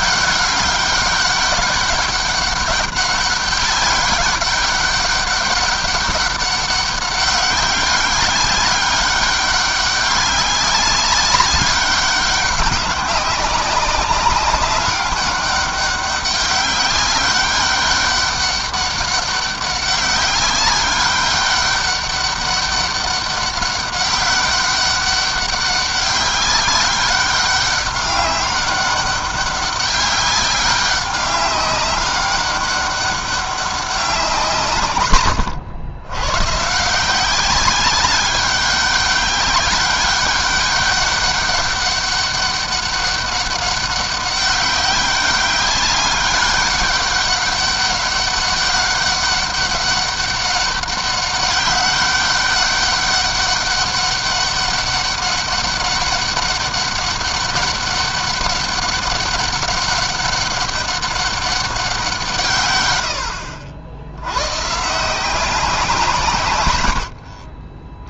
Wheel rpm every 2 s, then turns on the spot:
200, 200, 200, 190, 190, 190, 200, 200, 200, 200, 200, 200, 200, 200, 200, 200, 200, 120, 170, 200, 200, 200, 190, 200, 200, 200, 200, 200, 200, 200, 200, 110, 160, 110.
none